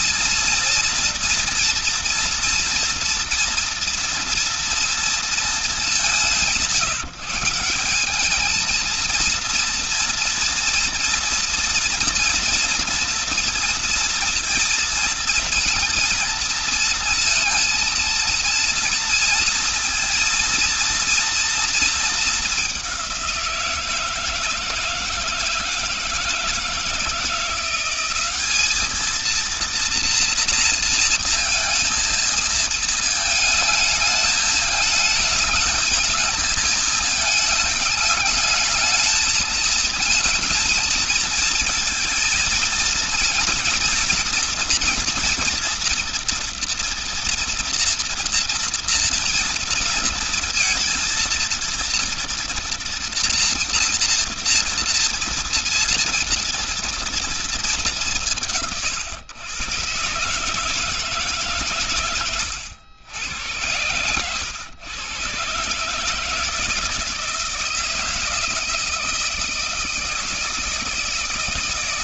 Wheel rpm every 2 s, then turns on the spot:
230, 230, 230, 180, 210, 230, 230, 230, 230, 230, 230, 210, 160, 160, 200, 230, 220, 220, 220, 210, 220, 220, 230, 230, 240, 230, 230, 230, 230, 150, 150, 120, 110, 160, 170, 160.
none